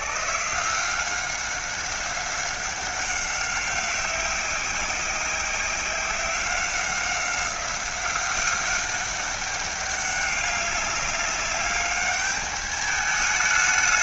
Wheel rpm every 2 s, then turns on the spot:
160, 190, 190, 190, 190, 200, 210.
none